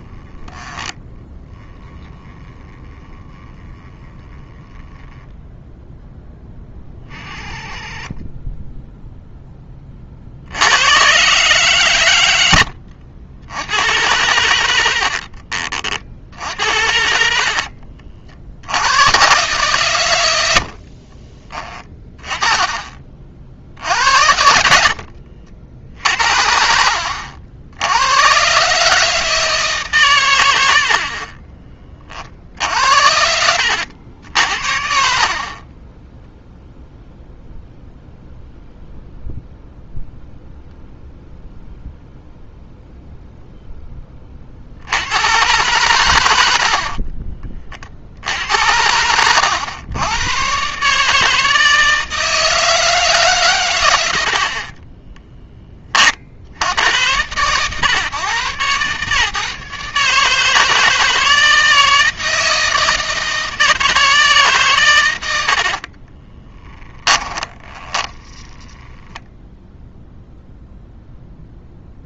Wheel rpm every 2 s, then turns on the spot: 10, 10, 0, 20, 10, 110, 80, 50, 70, 100, 40, 30, 60, 70, 140, 60, 70, 60, 0, 0, 0, 0, 80, 60, 90, 140, 160, 20, 100, 140, 160, 160, 120, 20, 10, 0.
14-18 20-22 24-26 46-48 54-56 66-68